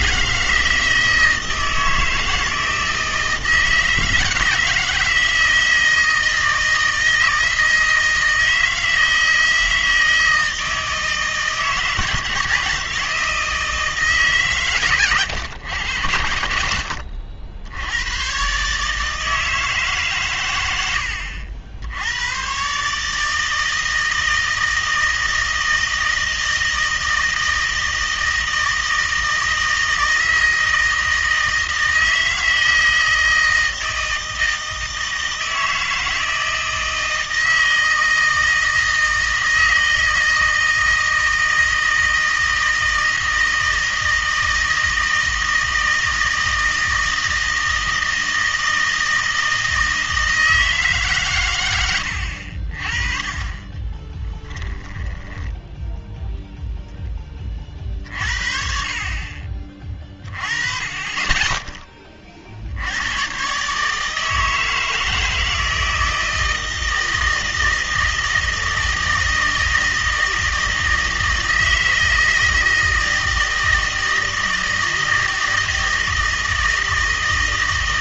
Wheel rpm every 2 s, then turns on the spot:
160, 160, 160, 160, 160, 160, 160, 130, 70, 140, 90, 130, 160, 160, 160, 160, 160, 160, 160, 160, 160, 160, 160, 160, 160, 160, 40, 10, 0, 40, 20, 70, 160, 160, 160, 160, 160, 160, 160.
54-56